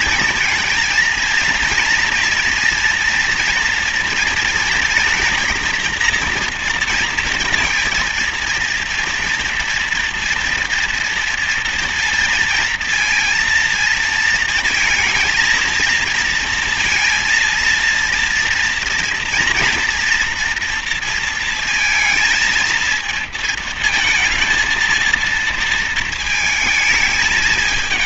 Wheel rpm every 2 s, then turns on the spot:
230, 240, 230, 230, 230, 230, 230, 230, 230, 230, 240, 230, 230, 220.
none